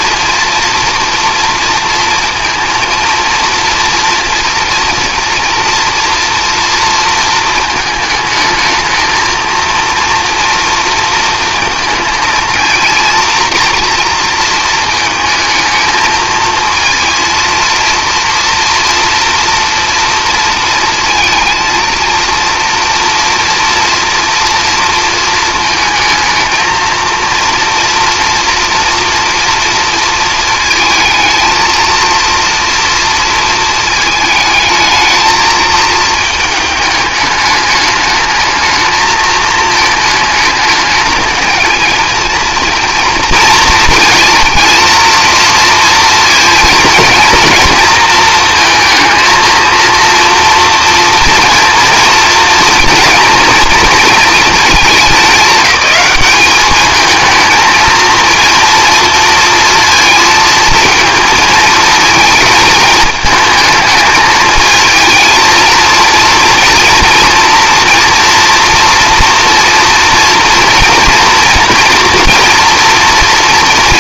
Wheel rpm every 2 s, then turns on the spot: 240, 230, 230, 240, 220, 230, 230, 220, 220, 230, 230, 230, 230, 220, 240, 220, 230, 220, 210, 220, 220, 230, 230, 230, 230, 230, 240, 210, 210, 230, 220, 220, 220, 230, 230, 230, 230.
none